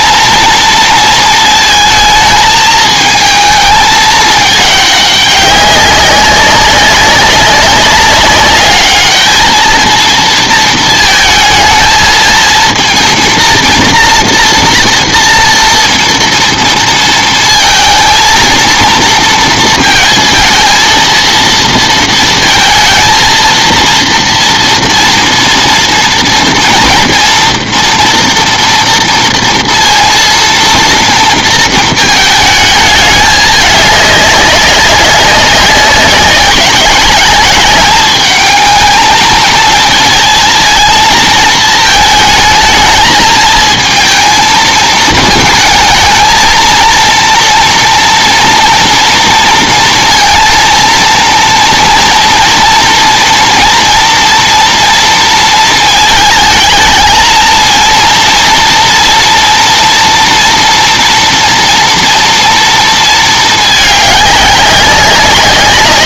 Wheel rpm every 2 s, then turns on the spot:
230, 220, 210, 200, 210, 230, 230, 230, 230, 230, 230, 230, 230, 230, 230, 230, 220, 200, 190, 210, 220, 220, 220, 230, 230, 230, 230, 230, 220, 230, 230, 230, 200.
none